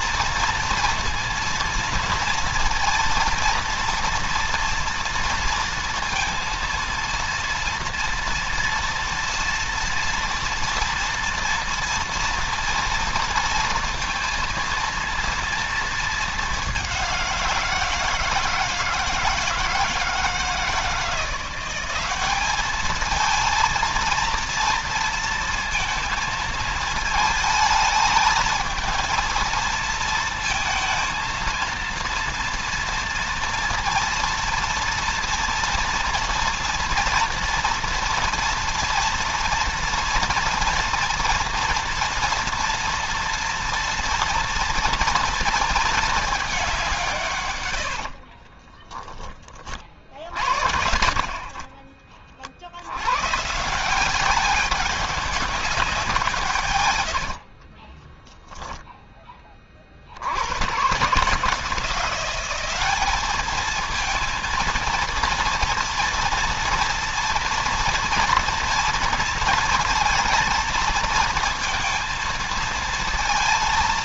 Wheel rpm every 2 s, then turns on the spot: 230, 230, 230, 230, 230, 240, 230, 230, 190, 160, 170, 220, 230, 220, 230, 230, 230, 230, 240, 230, 230, 230, 230, 170, 30, 50, 100, 200, 120, 20, 130, 210, 230, 230, 230, 230, 230.
48-50 56-58